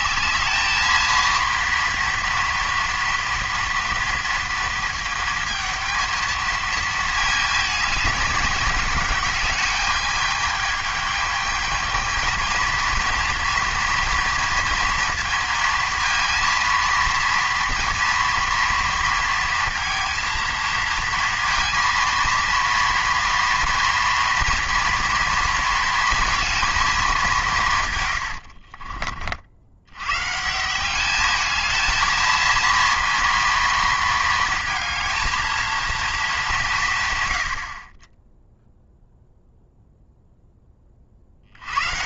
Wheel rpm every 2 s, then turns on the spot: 220, 230, 220, 220, 200, 210, 230, 230, 230, 230, 230, 230, 230, 220, 50, 190, 230, 230, 160, 0, 30.
28-30